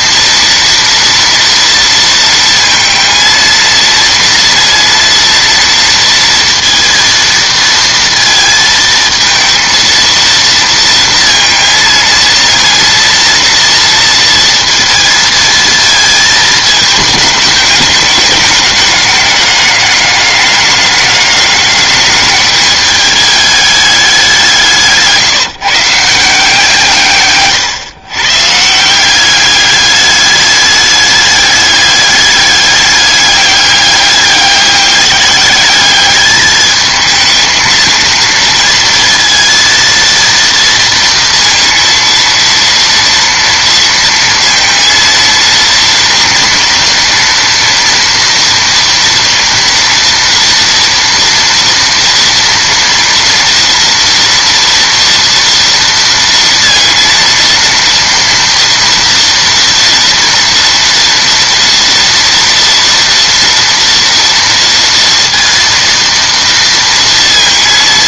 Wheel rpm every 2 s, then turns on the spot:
230, 230, 230, 230, 220, 230, 230, 230, 220, 200, 200, 210, 170, 160, 160, 210, 200, 200, 220, 230, 230, 230, 230, 230, 230, 230, 230, 230, 230, 230, 230, 230, 230, 230.
none